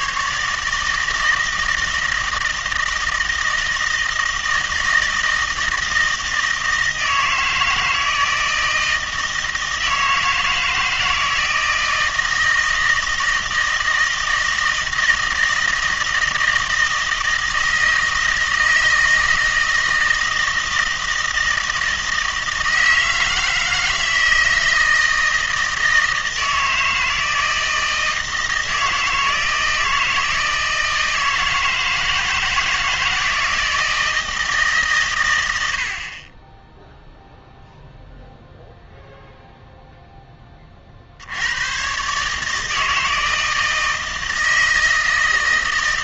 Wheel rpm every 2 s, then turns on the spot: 150, 160, 160, 160, 160, 160, 160, 160, 160, 160, 160, 160, 160, 160, 160, 160, 160, 150, 10, 0, 30, 160, 160.
none